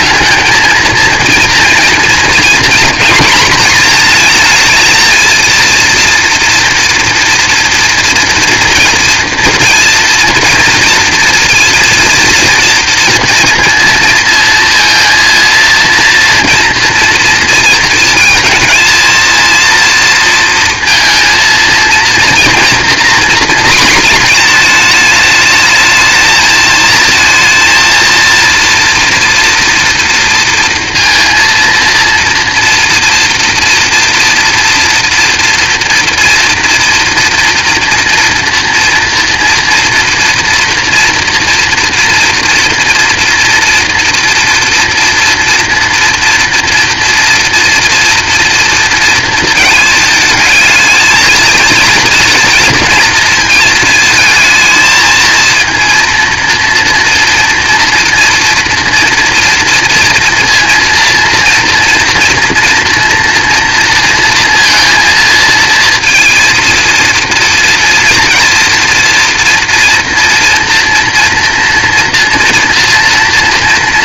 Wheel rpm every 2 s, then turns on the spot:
220, 230, 230, 230, 230, 230, 230, 230, 240, 220, 230, 240, 230, 220, 230, 230, 230, 230, 230, 230, 240, 240, 230, 230, 230, 220, 230, 220, 230, 230, 230, 230, 230, 230, 230, 240, 230.
none